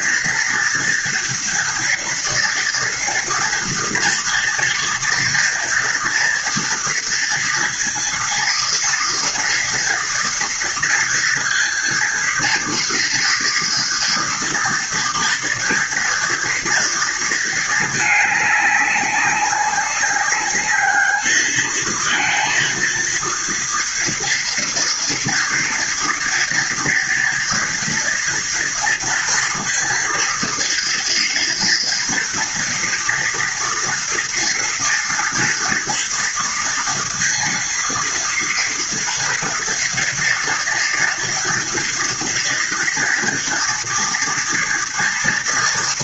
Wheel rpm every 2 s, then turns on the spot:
230, 230, 240, 230, 230, 230, 230, 230, 230, 200, 220, 230, 230, 230, 230, 230, 230, 230, 230, 230, 230, 230, 230.
none